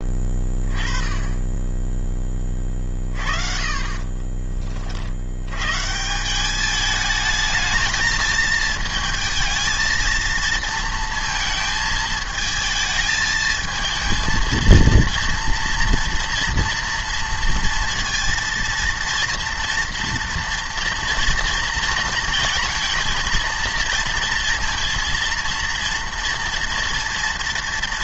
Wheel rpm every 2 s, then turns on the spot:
20, 30, 40, 210, 220, 230, 220, 230, 230, 230, 240, 230, 230, 230.
none